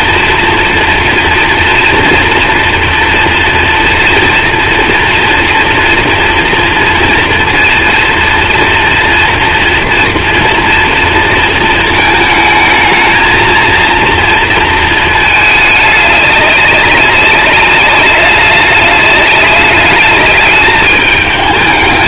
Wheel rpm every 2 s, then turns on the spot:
230, 230, 230, 230, 230, 230, 220, 230, 200, 200, 210.
none